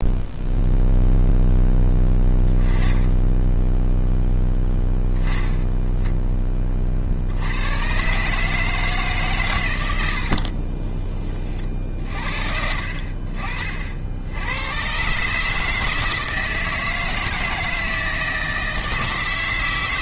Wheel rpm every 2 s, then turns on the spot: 0, 10, 0, 20, 150, 50, 50, 100, 160, 160.
10-12